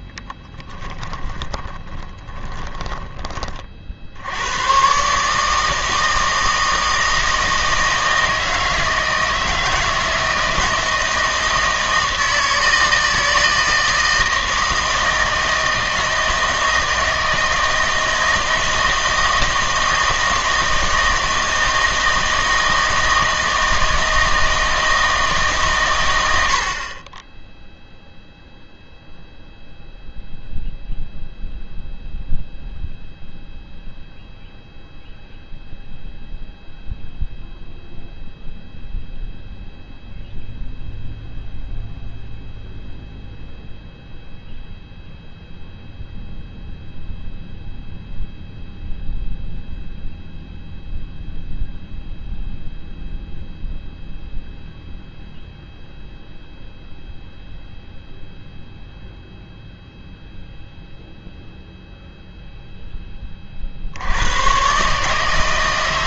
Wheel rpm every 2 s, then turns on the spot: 10, 10, 110, 160, 160, 160, 160, 160, 160, 160, 160, 160, 160, 60, 0, 0, 0, 0, 0, 0, 0, 0, 0, 0, 0, 0, 0, 0, 0, 0, 0, 0, 130.
0-4